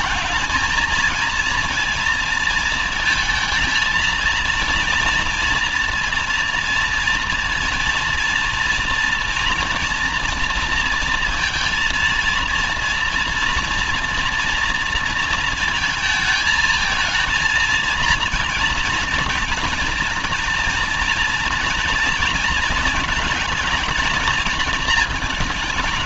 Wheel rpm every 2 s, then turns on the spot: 230, 230, 240, 230, 240, 230, 230, 230, 230, 230, 230, 220, 220.
none